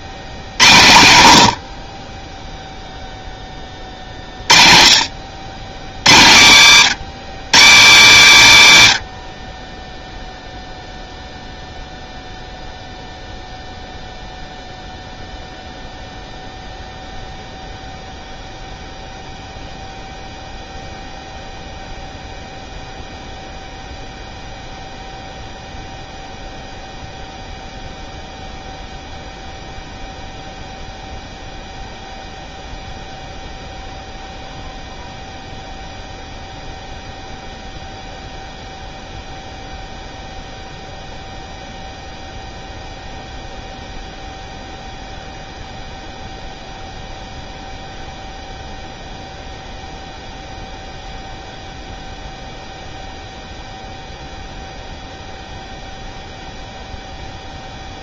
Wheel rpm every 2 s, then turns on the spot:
90, 0, 50, 120, 110, 0, 0, 0, 0, 0, 0, 0, 0, 0, 0, 0, 0, 0, 0, 0, 0, 0, 0, 0, 0, 0, 0, 0, 0.
none